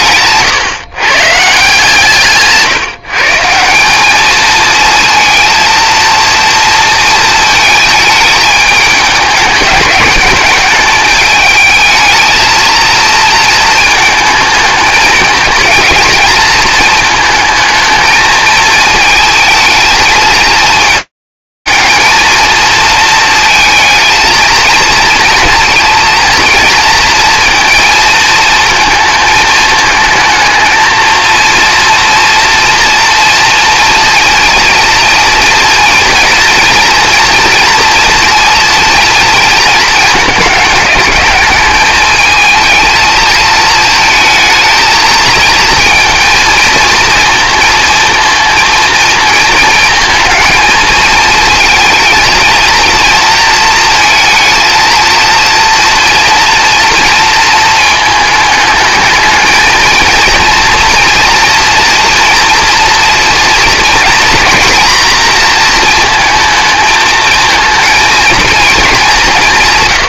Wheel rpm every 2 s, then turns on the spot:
130, 150, 230, 230, 210, 210, 230, 220, 220, 220, 220, 230, 230, 230, 220, 230, 230, 230, 230, 220, 200, 220, 220, 230, 220, 230, 230, 230, 230, 220, 230, 230, 230, 220, 190.
none